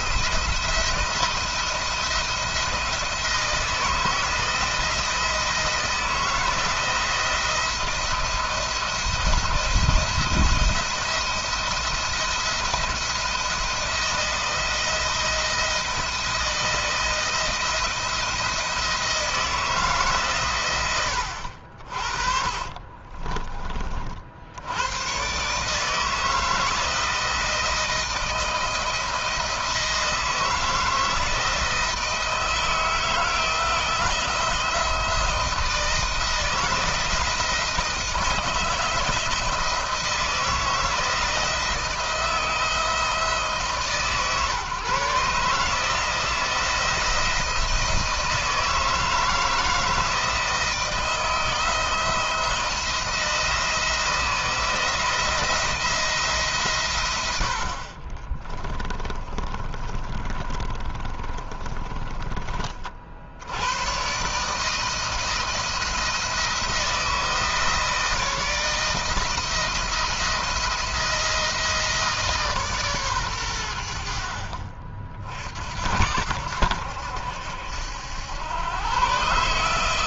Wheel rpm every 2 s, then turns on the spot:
170, 160, 170, 160, 170, 170, 170, 170, 160, 160, 100, 40, 100, 160, 170, 160, 160, 160, 170, 160, 170, 160, 140, 170, 160, 160, 170, 170, 130, 20, 30, 40, 150, 160, 160, 170, 140, 50, 80, 120.
20-24 58-62